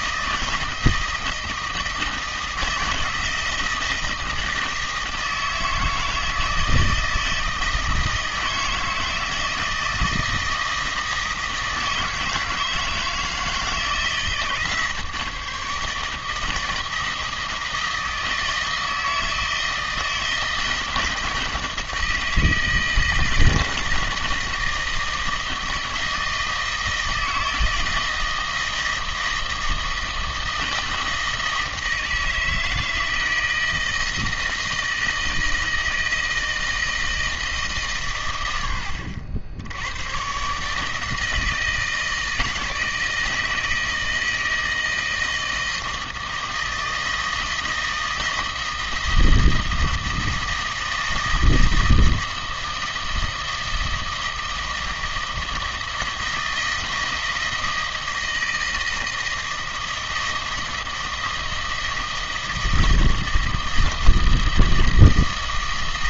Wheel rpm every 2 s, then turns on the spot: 160, 160, 160, 160, 160, 160, 160, 160, 160, 160, 160, 160, 160, 160, 160, 160, 160, 160, 160, 90, 140, 160, 160, 160, 160, 160, 160, 160, 160, 160, 160, 160, 160.
none